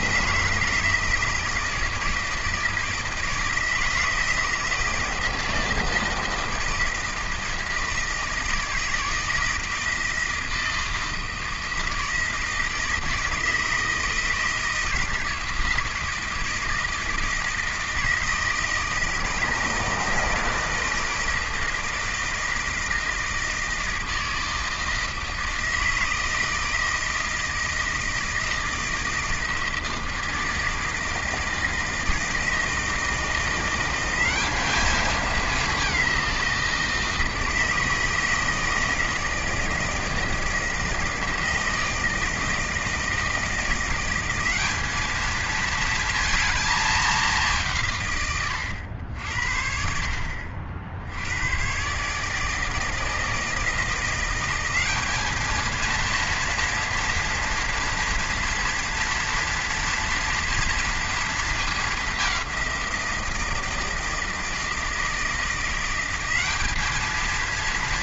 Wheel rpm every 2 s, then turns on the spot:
160, 160, 160, 160, 160, 160, 160, 160, 160, 160, 160, 160, 160, 160, 160, 160, 160, 210, 170, 160, 160, 160, 200, 220, 100, 50, 150, 180, 230, 240, 230, 190, 160, 200.
none